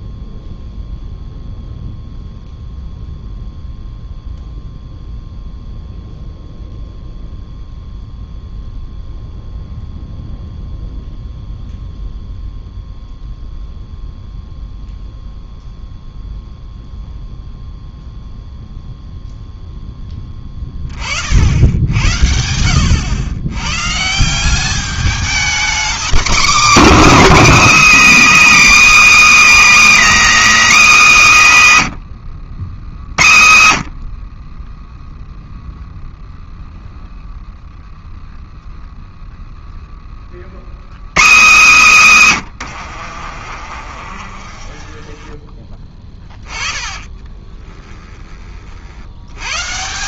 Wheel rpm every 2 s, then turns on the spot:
0, 0, 0, 0, 0, 0, 0, 0, 0, 0, 20, 80, 190, 270, 310, 300, 110, 10, 0, 0, 90, 110, 30, 20, 40.
42-48